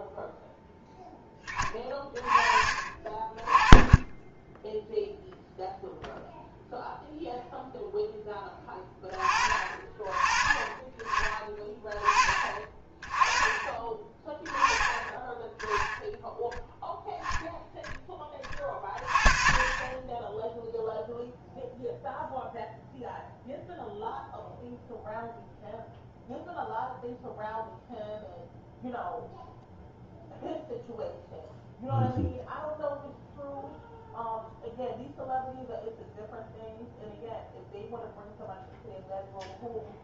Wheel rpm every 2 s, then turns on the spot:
0, 30, 10, 0, 20, 30, 20, 10, 0, 20, 0, 0, 0, 0, 0, 0, 0, 0, 0, 0.
none